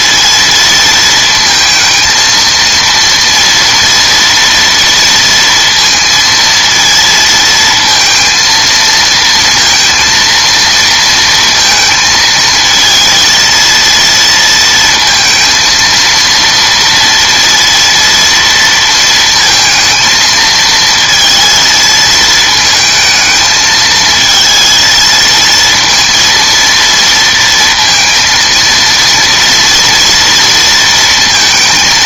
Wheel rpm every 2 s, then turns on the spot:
230, 230, 230, 230, 230, 230, 220, 230, 230, 230, 220, 220, 230, 230, 230, 230.
none